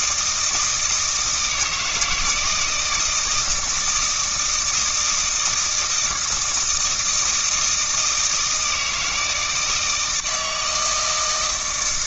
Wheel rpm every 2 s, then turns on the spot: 160, 170, 160, 160, 160, 160.
none